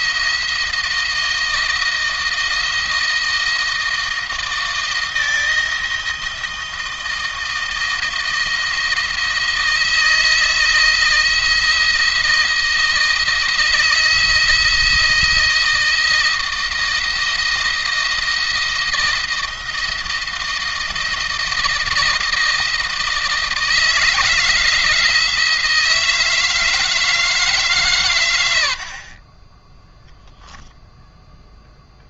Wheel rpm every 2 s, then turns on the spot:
160, 160, 170, 160, 170, 160, 160, 160, 170, 170, 160, 160, 170, 160, 60, 0.
none